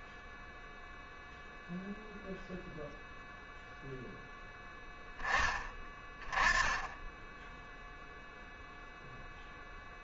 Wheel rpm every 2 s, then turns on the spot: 0, 0, 10, 10, 0.
none